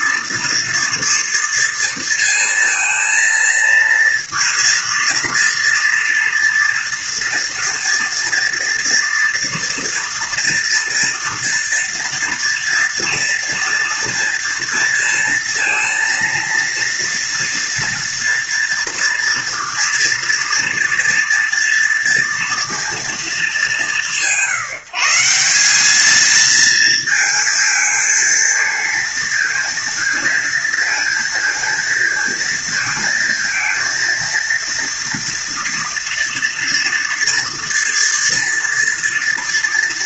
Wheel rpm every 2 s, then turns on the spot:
230, 230, 230, 230, 230, 230, 230, 230, 230, 230, 230, 230, 160, 220, 230, 230, 230, 230, 230, 230.
none